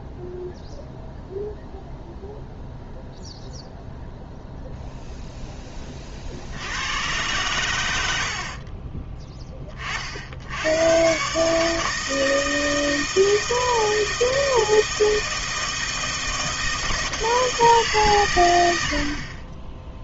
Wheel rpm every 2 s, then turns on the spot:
0, 0, 0, 80, 40, 90, 160, 160, 160, 100.
8-10